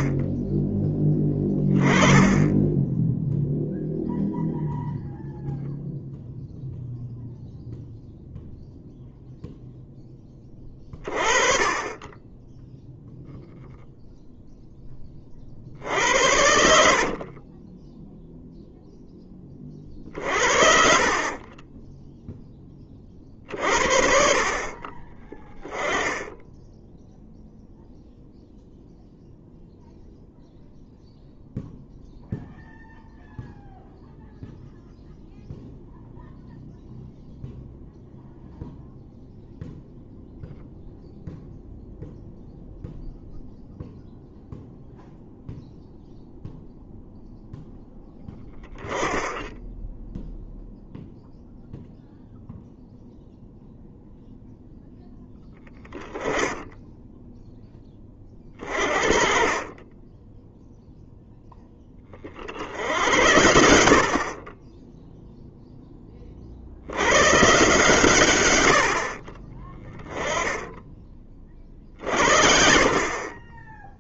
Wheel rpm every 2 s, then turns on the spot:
10, 10, 0, 0, 0, 20, 0, 10, 60, 0, 40, 10, 50, 10, 0, 0, 0, 0, 0, 0, 0, 0, 0, 0, 10, 0, 0, 0, 10, 40, 0, 80, 20, 80, 60, 10, 40.
16-18 20-22